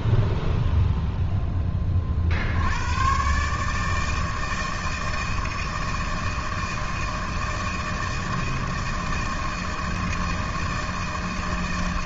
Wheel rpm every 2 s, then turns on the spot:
0, 120, 160, 160, 160, 160.
none